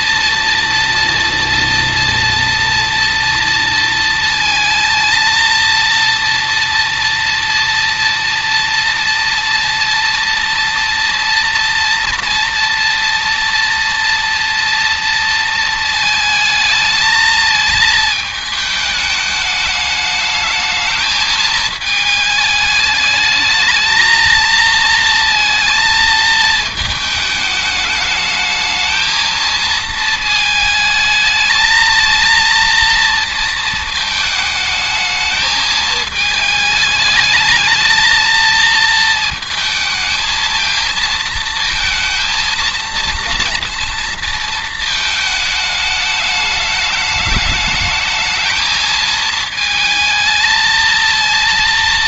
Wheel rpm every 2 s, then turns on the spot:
230, 230, 230, 230, 230, 230, 230, 230, 220, 210, 220, 220, 230, 220, 220, 220, 230, 220, 210, 220, 230, 230, 220, 210, 220, 230.
none